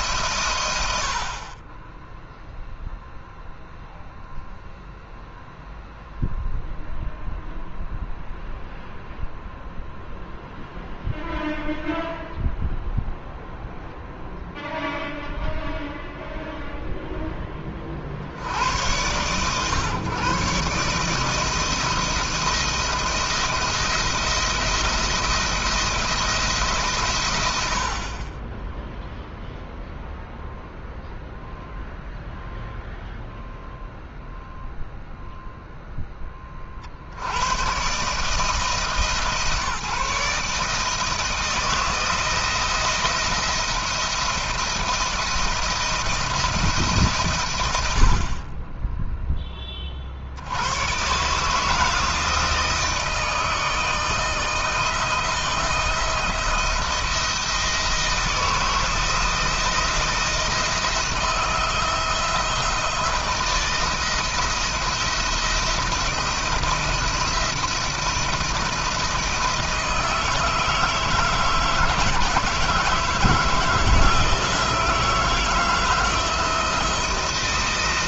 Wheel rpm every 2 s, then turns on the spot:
80, 0, 0, 0, 0, 0, 0, 0, 0, 90, 150, 160, 170, 130, 0, 0, 0, 0, 50, 160, 160, 170, 170, 140, 10, 110, 160, 160, 160, 160, 170, 170, 170, 160, 160, 160, 160, 160, 170.
none